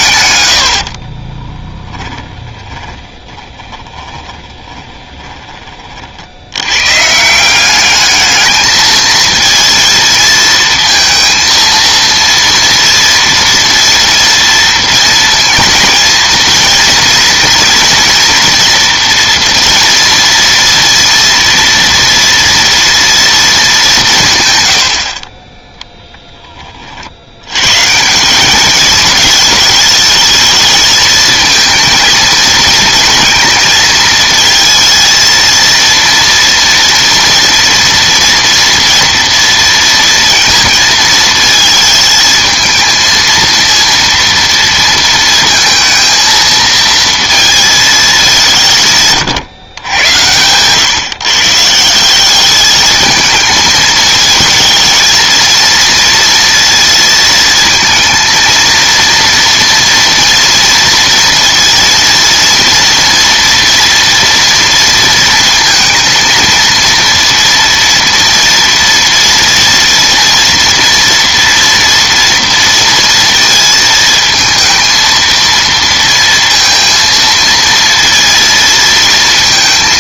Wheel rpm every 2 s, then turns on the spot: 90, 20, 30, 100, 220, 230, 230, 230, 230, 230, 230, 230, 110, 30, 210, 220, 230, 230, 230, 230, 230, 220, 230, 230, 170, 120, 210, 220, 230, 230, 230, 230, 230, 230, 240, 230, 230, 220, 230, 230.
2-6